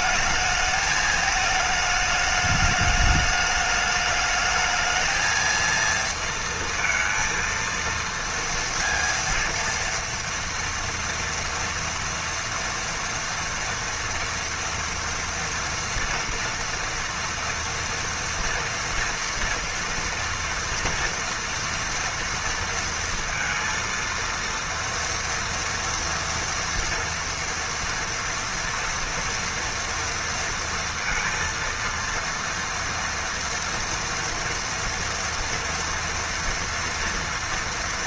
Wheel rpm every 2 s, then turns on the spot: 220, 210, 220, 230, 230, 230, 230, 230, 230, 240, 230, 230, 230, 230, 240, 230, 230, 230, 230.
none